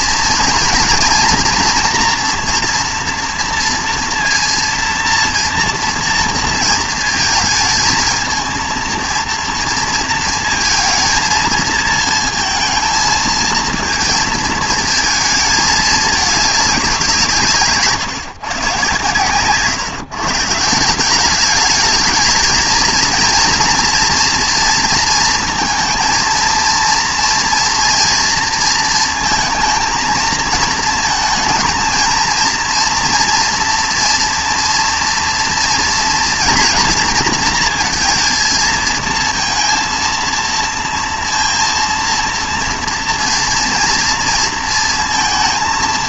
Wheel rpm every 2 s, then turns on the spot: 230, 230, 230, 230, 230, 220, 220, 220, 200, 130, 170, 220, 230, 230, 230, 220, 230, 230, 230, 230, 230, 230, 230.
none